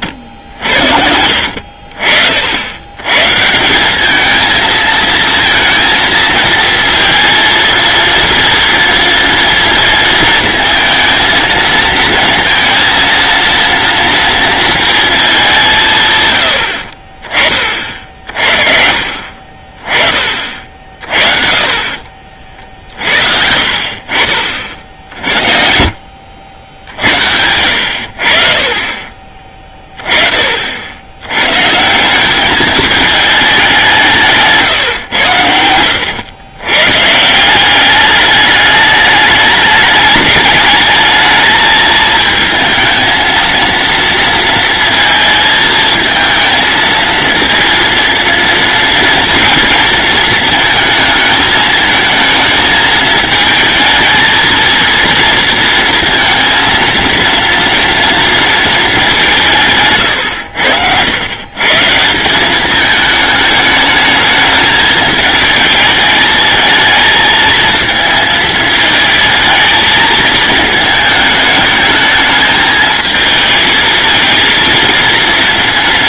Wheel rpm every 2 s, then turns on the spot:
70, 90, 220, 230, 230, 220, 230, 230, 60, 60, 40, 60, 50, 70, 40, 60, 210, 140, 120, 210, 210, 220, 230, 220, 230, 220, 220, 230, 230, 220, 90, 200, 220, 220, 220, 220, 220, 230.
none